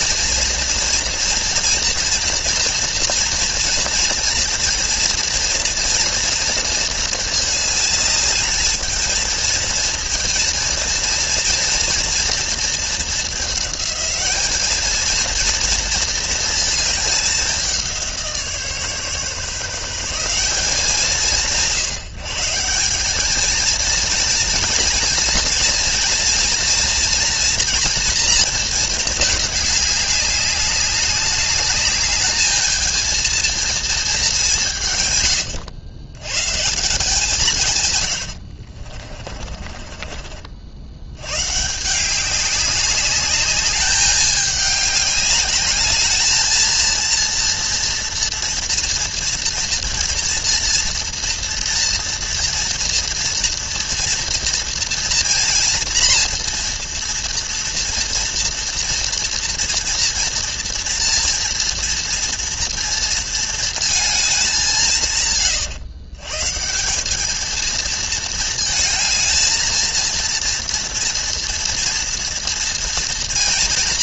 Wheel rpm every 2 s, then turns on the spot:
230, 240, 230, 230, 220, 230, 230, 220, 220, 150, 190, 170, 230, 230, 230, 200, 220, 190, 140, 60, 60, 190, 210, 220, 230, 230, 230, 230, 230, 230, 230, 230, 190, 150, 220, 230, 230.
38-40